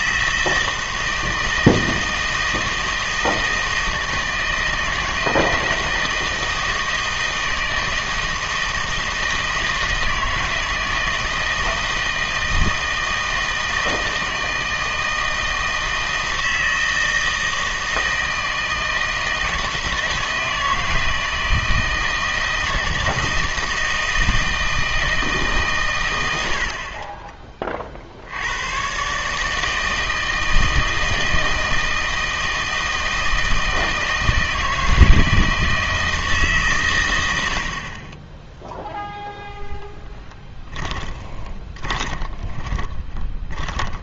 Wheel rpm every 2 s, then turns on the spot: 160, 160, 160, 160, 160, 160, 160, 160, 160, 160, 160, 160, 160, 70, 100, 160, 160, 160, 140, 10, 10, 20.
40-44